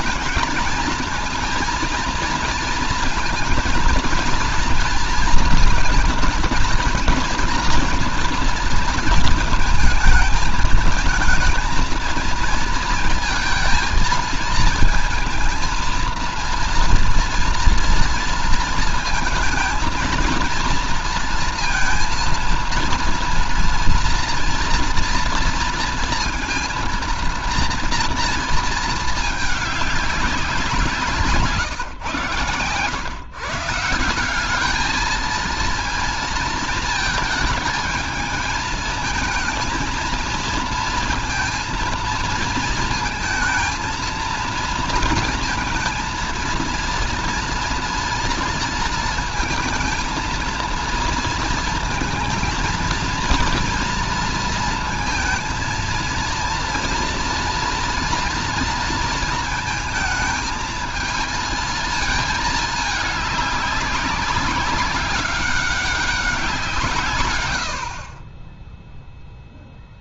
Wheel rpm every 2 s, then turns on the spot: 220, 230, 230, 230, 230, 220, 220, 220, 230, 230, 230, 230, 230, 230, 230, 190, 120, 190, 230, 220, 230, 230, 230, 230, 230, 220, 230, 230, 230, 230, 220, 220, 190, 180, 30.
none